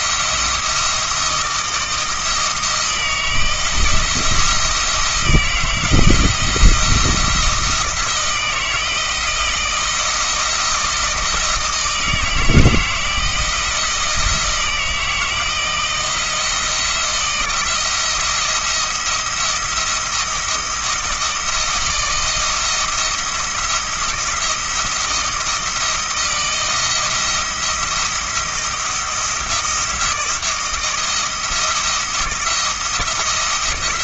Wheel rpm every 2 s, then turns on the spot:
160, 160, 160, 170, 160, 160, 160, 160, 170, 170, 160, 170, 170, 170, 170, 170, 170.
none